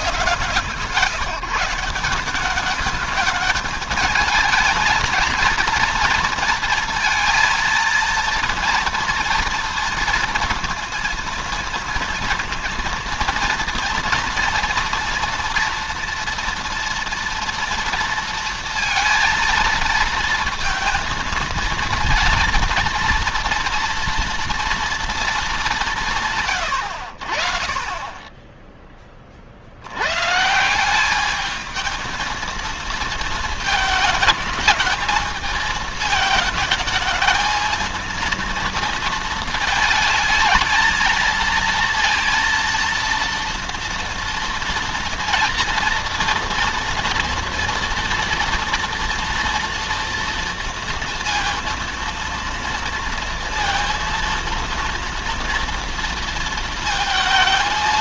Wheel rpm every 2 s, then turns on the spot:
150, 200, 220, 230, 230, 230, 230, 230, 230, 230, 230, 230, 230, 120, 20, 160, 220, 220, 210, 230, 220, 230, 240, 230, 230, 230, 230, 230, 230.
none